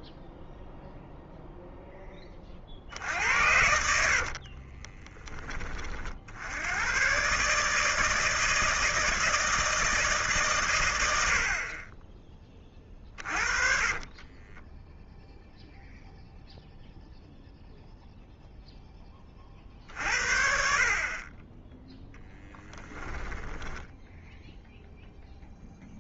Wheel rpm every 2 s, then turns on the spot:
0, 50, 30, 100, 160, 110, 20, 10, 0, 10, 50, 10, 0.
4-6 12-16 22-24